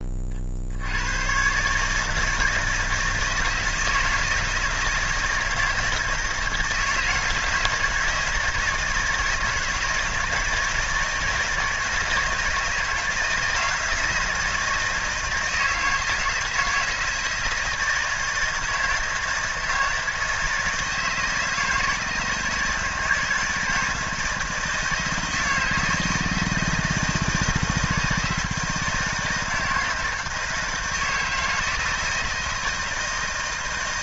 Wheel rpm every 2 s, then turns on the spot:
80, 160, 160, 160, 160, 160, 160, 170, 160, 160, 160, 160, 160, 160, 160, 160, 160.
none